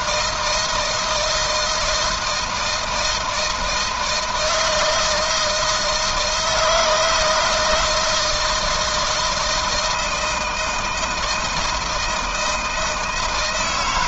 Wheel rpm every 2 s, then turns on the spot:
160, 170, 160, 160, 160, 160, 160.
none